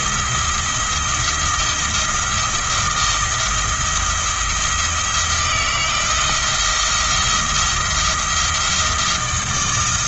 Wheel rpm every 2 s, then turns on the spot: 170, 170, 160, 170, 160.
none